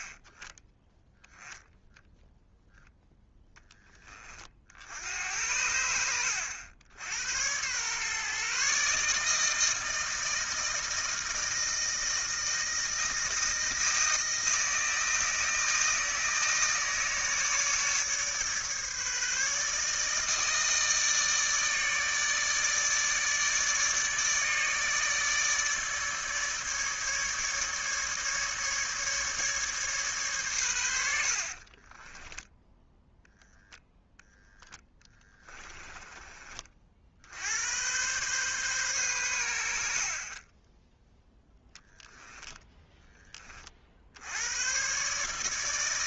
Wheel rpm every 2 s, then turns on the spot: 10, 0, 60, 90, 140, 160, 160, 160, 160, 150, 160, 150, 150, 150, 150, 120, 10, 0, 40, 130, 30, 10, 90.
none